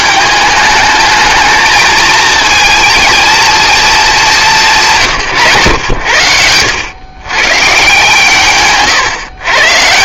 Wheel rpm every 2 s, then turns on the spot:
210, 230, 170, 90, 140.
none